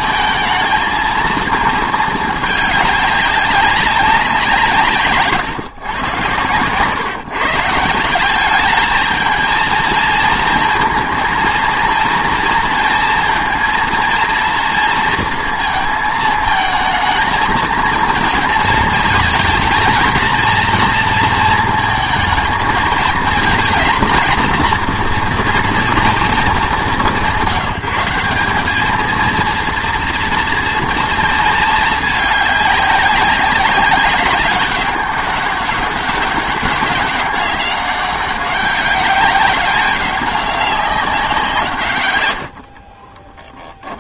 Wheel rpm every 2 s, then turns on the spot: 220, 210, 160, 120, 210, 230, 230, 230, 220, 220, 230, 220, 230, 210, 210, 230, 200, 190, 190, 190, 190, 60.
42-44